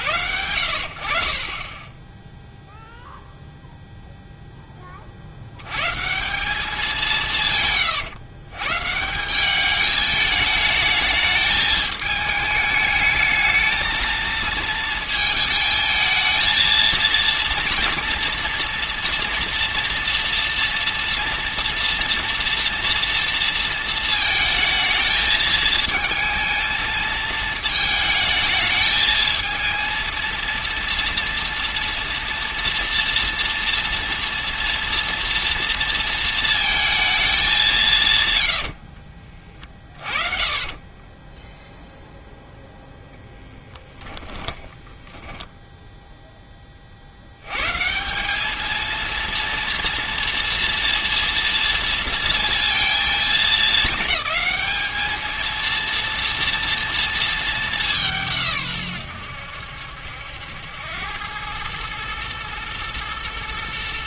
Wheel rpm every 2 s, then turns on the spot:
70, 0, 20, 190, 140, 220, 220, 220, 230, 230, 230, 230, 220, 220, 220, 230, 230, 230, 220, 60, 30, 0, 20, 40, 220, 230, 230, 210, 230, 130, 90, 110.
38-42 44-46